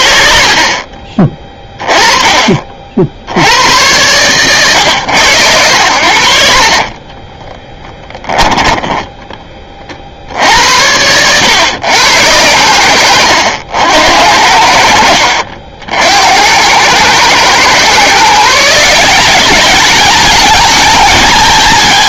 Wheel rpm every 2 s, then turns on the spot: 40, 30, 120, 60, 10, 90, 90, 60, 90, 160, 210.
none